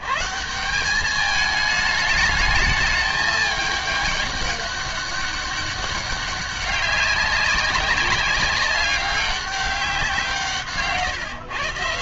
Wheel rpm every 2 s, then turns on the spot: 130, 210, 200, 200, 200, 160.
none